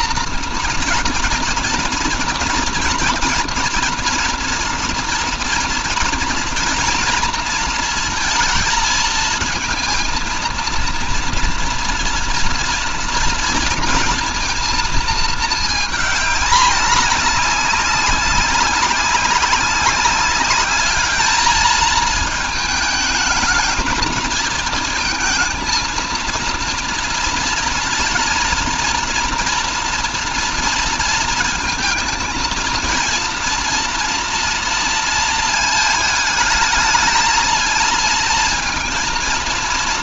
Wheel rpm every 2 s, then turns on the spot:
230, 230, 230, 230, 220, 230, 230, 230, 210, 190, 210, 220, 230, 230, 230, 230, 220, 230, 220, 230.
none